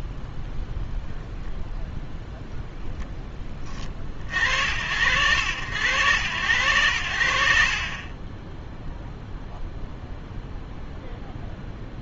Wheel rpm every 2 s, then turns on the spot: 0, 0, 70, 90, 0, 0.
none